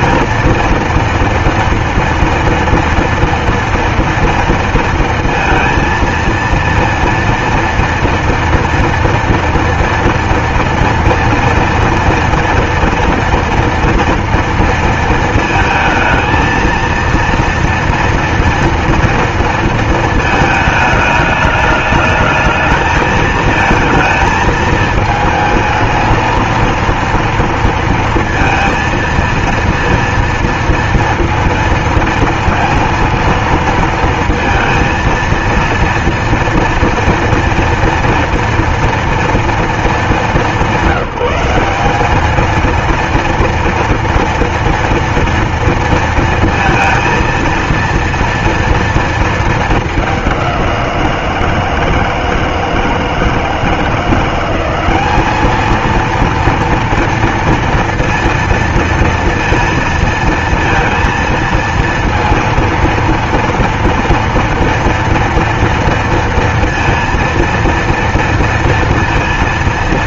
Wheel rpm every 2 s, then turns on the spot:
230, 230, 230, 230, 230, 230, 230, 230, 220, 230, 220, 210, 220, 230, 230, 230, 230, 230, 230, 230, 210, 210, 230, 230, 230, 200, 160, 170, 230, 230, 230, 230, 230, 230, 230.
none